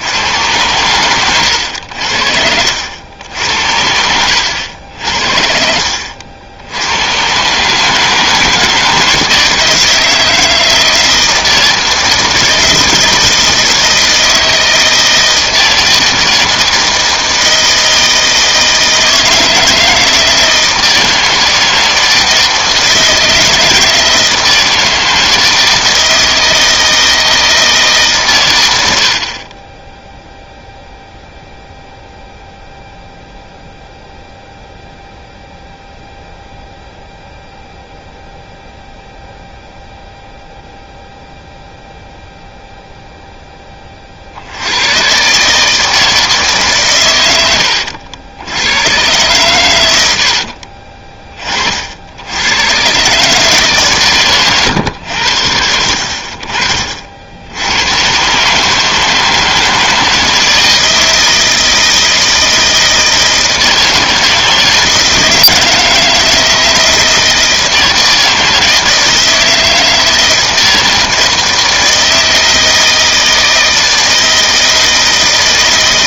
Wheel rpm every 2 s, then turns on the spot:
120, 80, 80, 90, 160, 160, 160, 160, 160, 160, 160, 160, 160, 160, 120, 0, 0, 0, 0, 0, 0, 0, 90, 140, 90, 60, 100, 120, 50, 150, 160, 160, 160, 160, 160, 160, 160, 160.
50-52